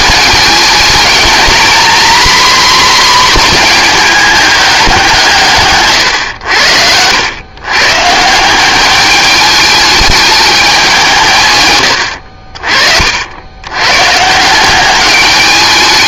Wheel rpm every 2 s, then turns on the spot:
220, 250, 200, 90, 180, 200, 50, 190.
12-14